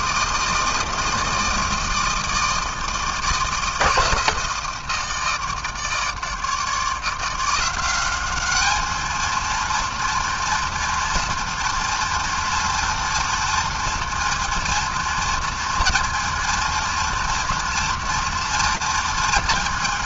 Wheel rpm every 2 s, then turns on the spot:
160, 160, 160, 160, 200, 230, 230, 230, 230, 230.
none